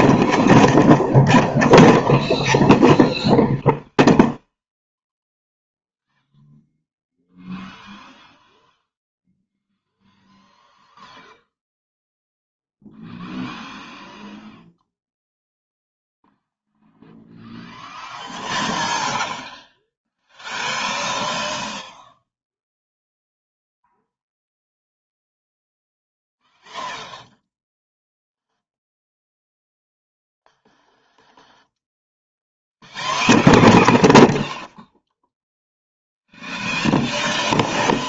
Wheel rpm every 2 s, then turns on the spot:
0, 0, 0, 0, 0, 0, 0, 0, 0, 0, 0, 0, 0, 0, 0, 0, 0, 0, 0.
none